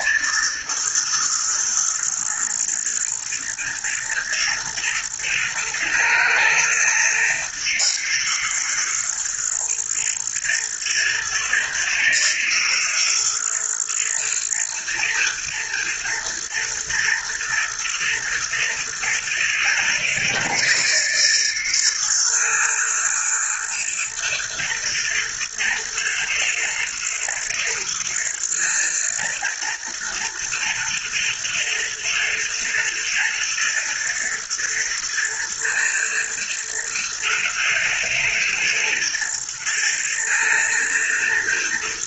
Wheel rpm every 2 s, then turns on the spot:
110, 110, 120, 120, 120, 110, 120, 110, 110, 110, 110, 120, 110, 110, 110, 110, 110, 110, 120, 110, 120.
none